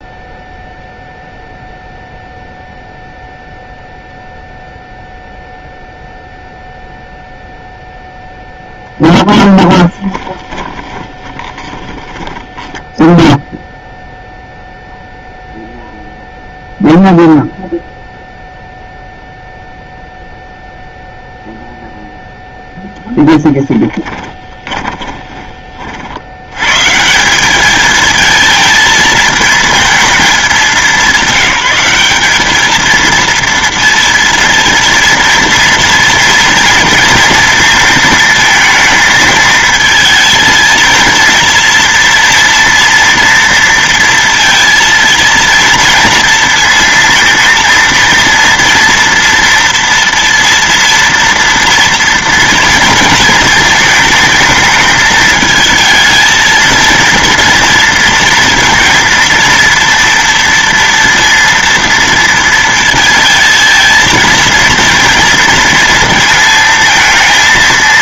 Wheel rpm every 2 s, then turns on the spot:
0, 0, 0, 0, 10, 20, 10, 0, 0, 0, 0, 0, 20, 130, 220, 200, 220, 230, 230, 220, 220, 230, 230, 230, 230, 230, 230, 220, 230, 230, 230, 230, 230, 230.
8-14 24-26